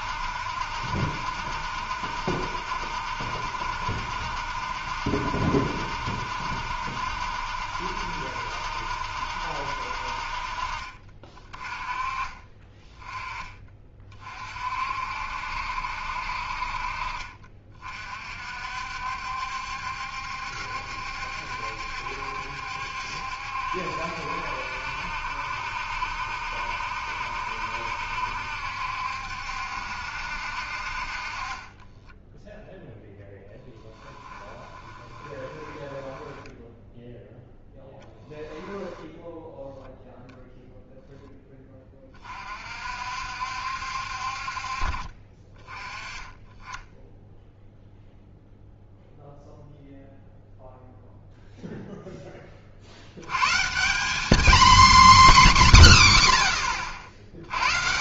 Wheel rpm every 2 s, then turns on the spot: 70, 70, 70, 70, 70, 40, 20, 50, 50, 60, 70, 70, 70, 70, 70, 50, 0, 20, 0, 10, 0, 50, 50, 10, 0, 0, 40, 260, 70.
34-36